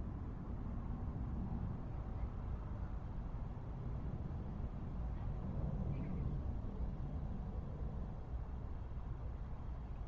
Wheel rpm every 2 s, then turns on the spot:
0, 0, 0, 0, 0.
none